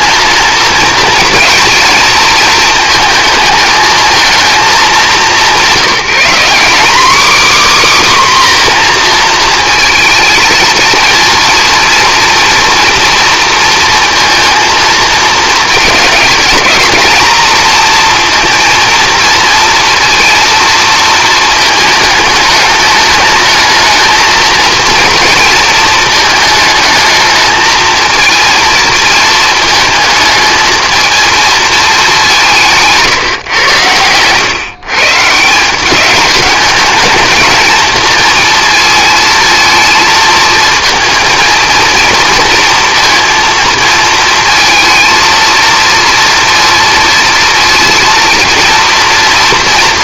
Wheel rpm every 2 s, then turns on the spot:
230, 220, 210, 230, 250, 230, 230, 230, 210, 230, 230, 210, 230, 220, 220, 220, 160, 130, 210, 230, 220, 230, 230, 230, 230.
32-34